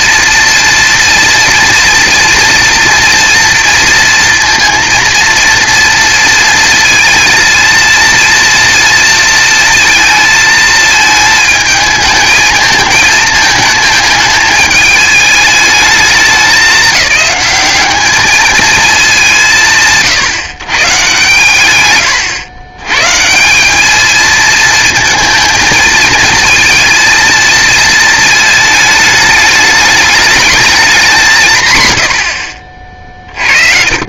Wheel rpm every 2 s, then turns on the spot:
230, 230, 230, 230, 230, 220, 220, 210, 200, 210, 130, 130, 230, 230, 210, 190, 30.
32-34